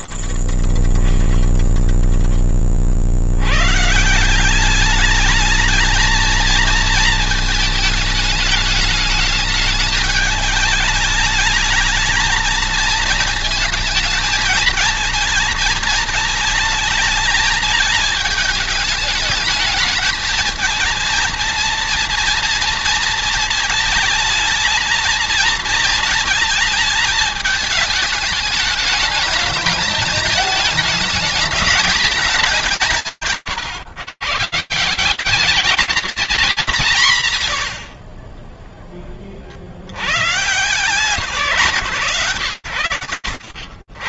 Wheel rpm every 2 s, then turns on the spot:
0, 20, 50, 210, 220, 210, 210, 220, 220, 220, 210, 230, 230, 230, 220, 210, 220, 160, 190, 20, 150, 100.
38-40